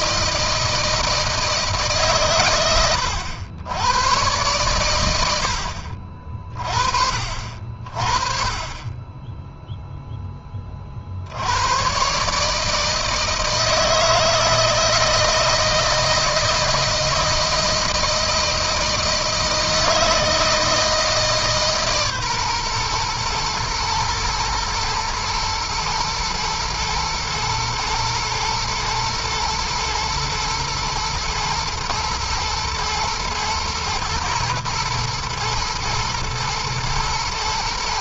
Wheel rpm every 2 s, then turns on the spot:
160, 100, 110, 50, 10, 40, 150, 160, 170, 160, 160, 120, 120, 120, 120, 120, 110, 120, 120.
none